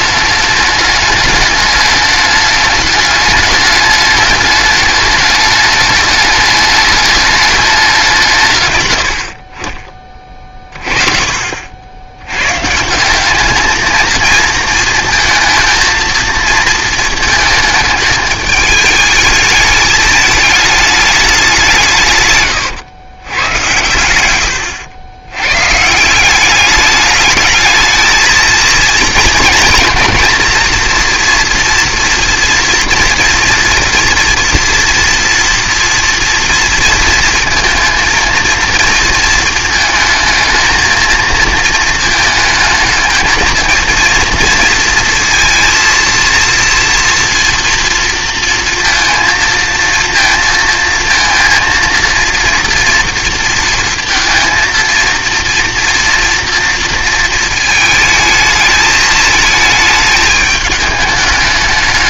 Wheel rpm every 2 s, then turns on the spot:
210, 210, 210, 210, 140, 40, 140, 230, 230, 220, 210, 120, 100, 200, 230, 240, 230, 240, 230, 230, 220, 220, 230, 230, 230, 230, 230, 230, 230, 220, 220.
none